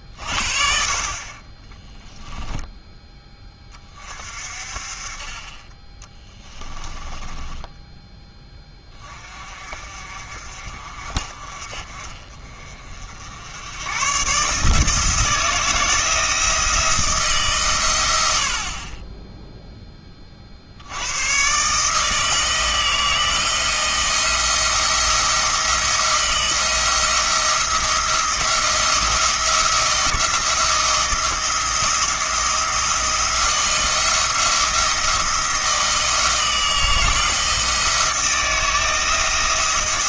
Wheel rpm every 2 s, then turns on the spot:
50, 10, 40, 20, 20, 50, 50, 160, 160, 30, 70, 160, 170, 170, 170, 170, 170, 160, 160, 160.
6-8